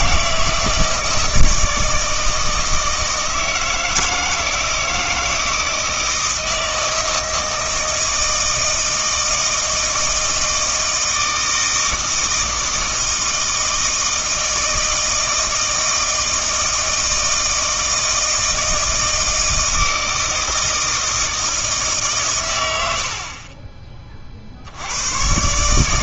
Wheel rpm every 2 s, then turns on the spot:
160, 160, 160, 160, 160, 160, 160, 160, 160, 160, 160, 100, 80.
none